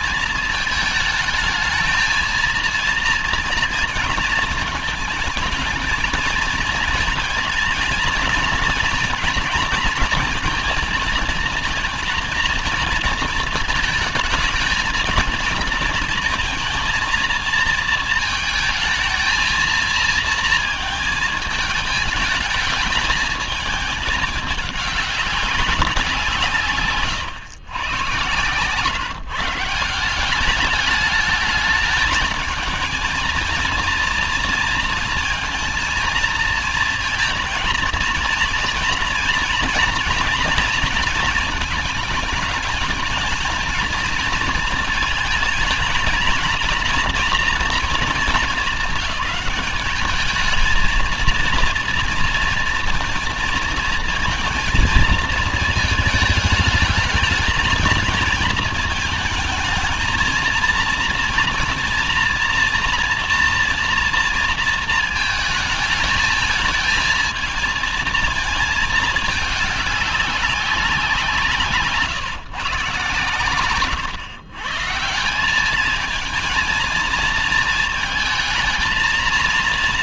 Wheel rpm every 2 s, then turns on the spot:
220, 230, 220, 230, 240, 230, 230, 220, 230, 220, 230, 220, 200, 140, 140, 210, 230, 230, 230, 240, 230, 220, 220, 230, 200, 230, 230, 230, 220, 220, 230, 240, 220, 220, 220, 190, 140, 160, 220, 230.
none